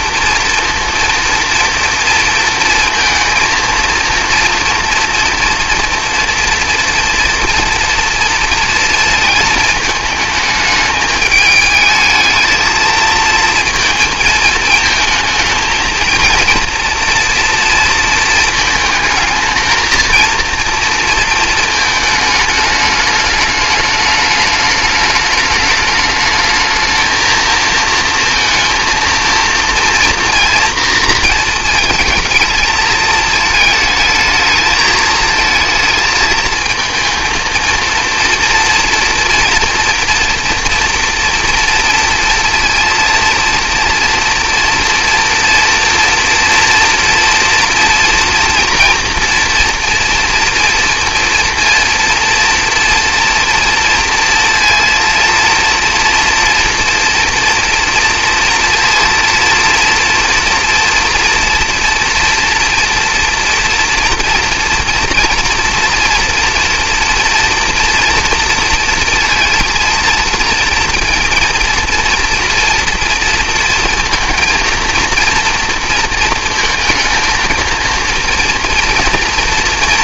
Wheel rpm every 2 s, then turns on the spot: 230, 230, 230, 230, 230, 220, 230, 220, 230, 220, 230, 210, 210, 220, 230, 230, 220, 220, 220, 230, 230, 230, 230, 230, 230, 230, 230, 230, 240, 230, 230, 230, 230, 240, 230, 230, 230, 230, 230, 230.
none